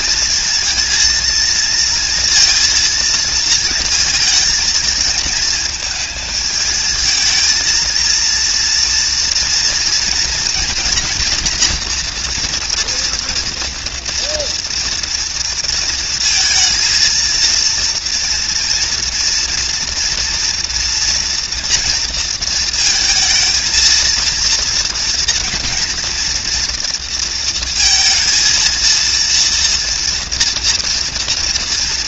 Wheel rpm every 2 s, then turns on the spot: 240, 230, 230, 220, 230, 230, 240, 230, 230, 230, 240, 230, 230, 230, 230, 230.
none